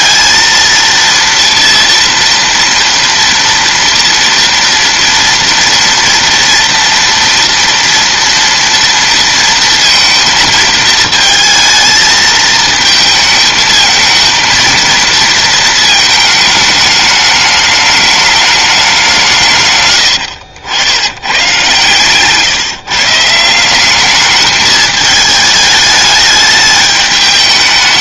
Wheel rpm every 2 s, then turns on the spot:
230, 230, 230, 230, 230, 220, 220, 220, 220, 200, 80, 150, 210, 210.
none